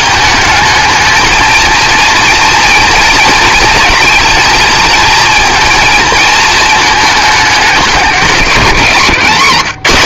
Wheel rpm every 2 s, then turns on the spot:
210, 230, 230, 220, 150.
none